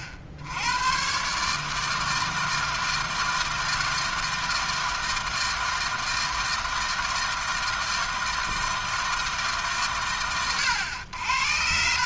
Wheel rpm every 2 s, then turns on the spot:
90, 160, 160, 160, 160, 80.
none